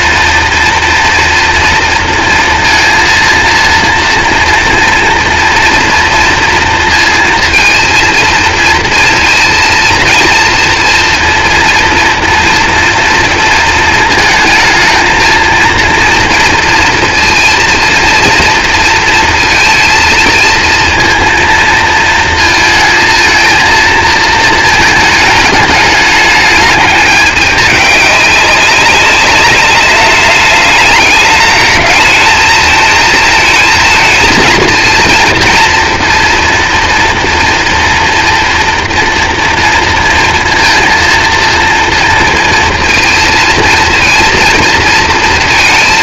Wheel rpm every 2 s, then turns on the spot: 230, 230, 230, 230, 230, 230, 230, 230, 230, 230, 230, 220, 220, 210, 200, 210, 220, 230, 230, 230, 230, 230, 230.
none